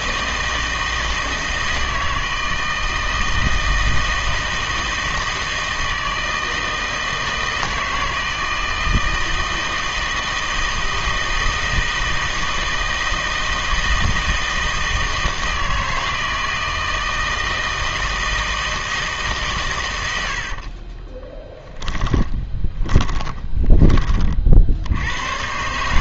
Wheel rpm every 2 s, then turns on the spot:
160, 160, 160, 160, 160, 160, 160, 160, 160, 160, 50, 20, 70.
20-24